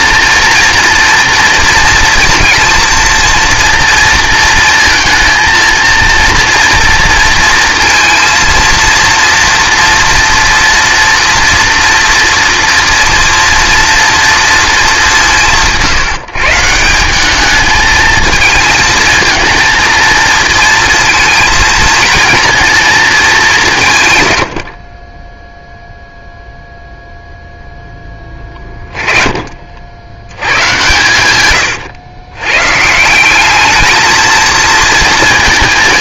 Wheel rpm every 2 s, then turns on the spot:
230, 230, 220, 230, 230, 230, 230, 200, 170, 220, 220, 230, 40, 0, 20, 120, 150, 230.
28-30